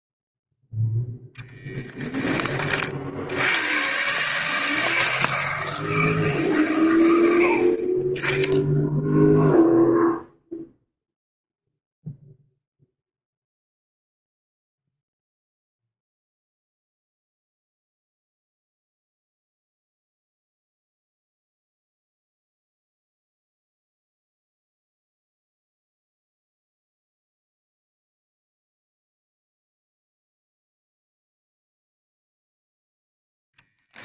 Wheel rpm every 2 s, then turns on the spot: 0, 30, 160, 120, 0, 0, 0, 0, 0, 0, 0, 0, 0, 0, 0, 0, 0.
none